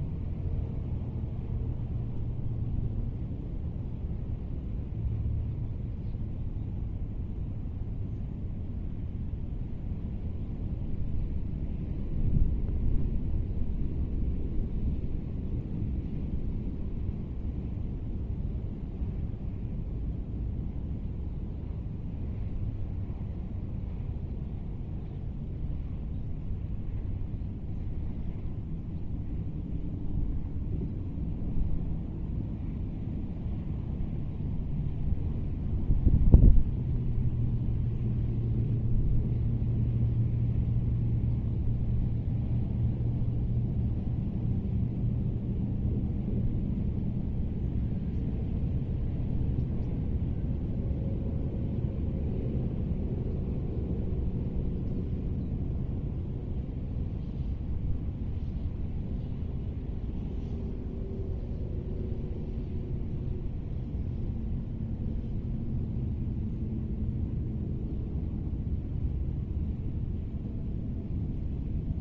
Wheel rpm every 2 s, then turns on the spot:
0, 0, 0, 0, 0, 0, 0, 0, 0, 0, 0, 0, 0, 0, 0, 0, 0, 0, 0, 0, 0, 0, 0, 0, 0, 0, 0, 0, 0, 0, 0, 0, 0, 0, 0, 0.
none